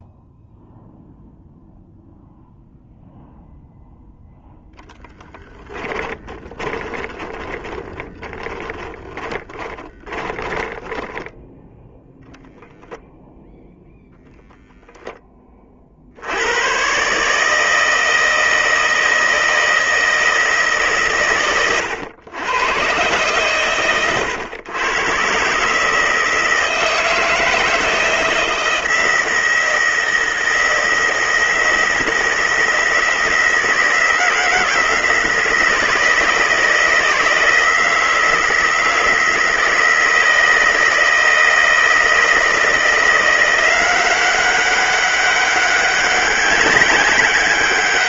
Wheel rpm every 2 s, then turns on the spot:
0, 0, 10, 20, 20, 10, 0, 10, 120, 160, 150, 120, 120, 160, 160, 160, 160, 160, 160, 160, 160, 160, 190, 190.
4-12